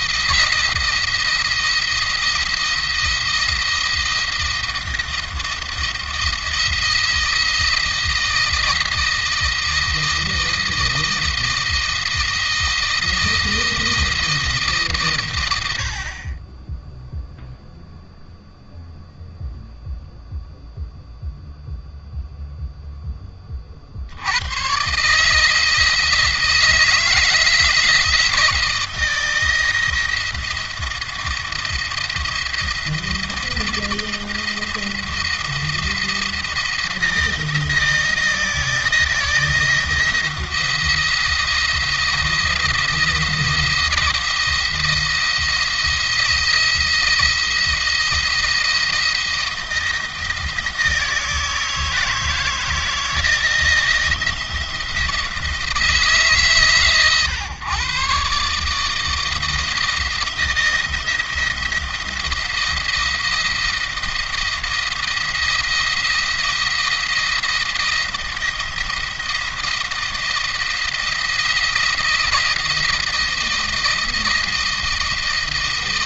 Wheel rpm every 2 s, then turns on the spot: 170, 170, 170, 170, 170, 170, 160, 150, 20, 0, 0, 0, 110, 170, 170, 170, 170, 170, 170, 160, 170, 170, 160, 170, 170, 160, 160, 170, 130, 150, 160, 170, 170, 170, 170, 170, 160, 160.
none